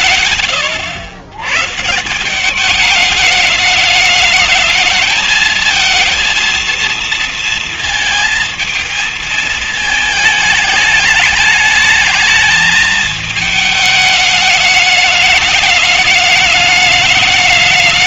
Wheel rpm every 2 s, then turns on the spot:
100, 210, 220, 230, 220, 210, 220, 210, 210.
none